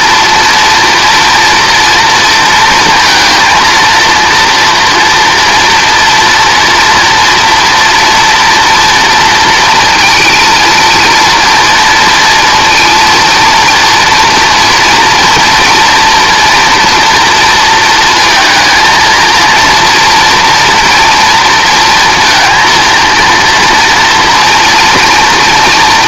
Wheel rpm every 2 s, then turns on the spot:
230, 230, 230, 230, 240, 230, 230, 240, 230, 230, 240, 230, 230.
none